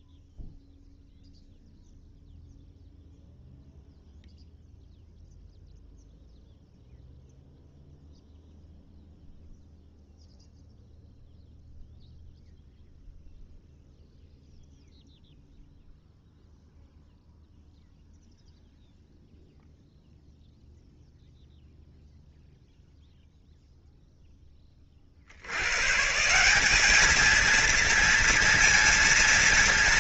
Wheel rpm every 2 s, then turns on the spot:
0, 0, 0, 0, 0, 0, 0, 0, 0, 0, 0, 0, 20, 190, 230.
none